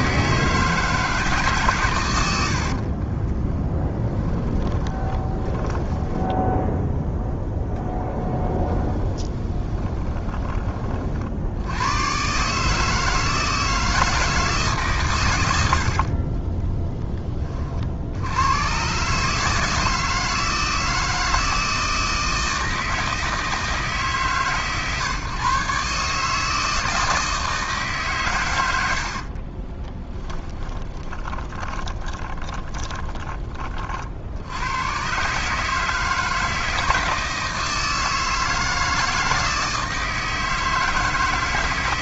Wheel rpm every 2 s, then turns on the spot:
160, 40, 20, 0, 10, 30, 150, 140, 10, 130, 160, 160, 130, 160, 90, 20, 20, 110, 160, 160, 160.
2-6 8-10 30-32